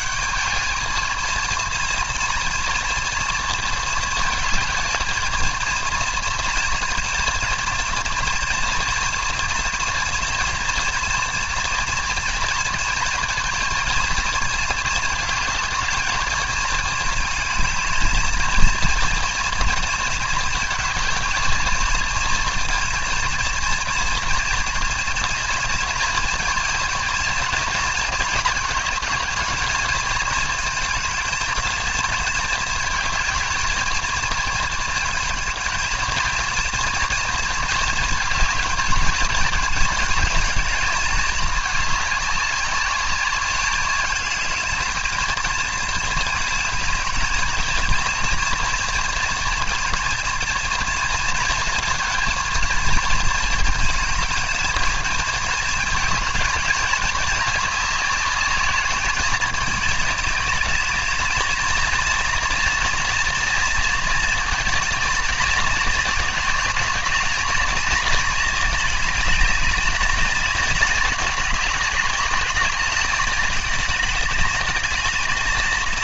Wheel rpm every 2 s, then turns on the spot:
220, 230, 220, 230, 230, 230, 230, 230, 220, 230, 220, 230, 230, 230, 220, 220, 220, 220, 230, 220, 220, 200, 220, 210, 230, 230, 230, 230, 220, 210, 210, 230, 230, 210, 210, 210, 210, 230.
none